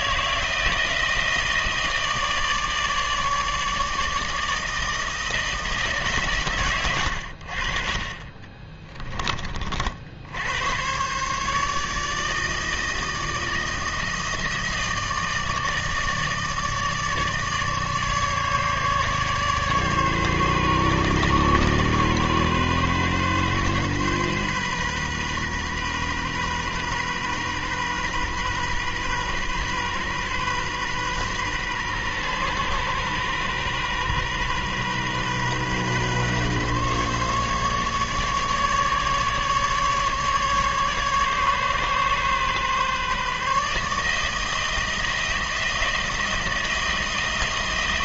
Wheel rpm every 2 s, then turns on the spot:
160, 150, 160, 90, 20, 130, 160, 160, 150, 150, 130, 130, 130, 130, 130, 130, 120, 130, 140, 150, 140, 150, 160, 160.
6-10